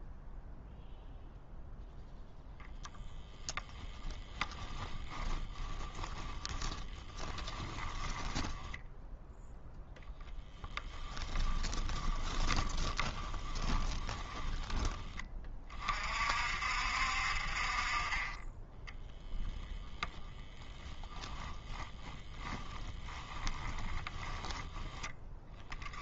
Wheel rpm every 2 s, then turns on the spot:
0, 0, 10, 20, 0, 10, 10, 10, 60, 10, 0, 10, 10.
4-8 10-14 18-20 22-24